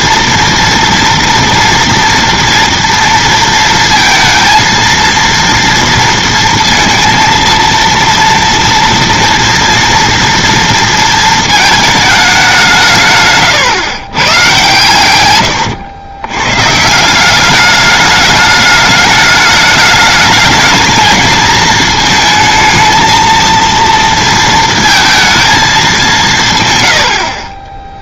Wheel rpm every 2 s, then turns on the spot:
230, 240, 230, 230, 230, 230, 190, 120, 140, 210, 220, 220, 230, 150.
none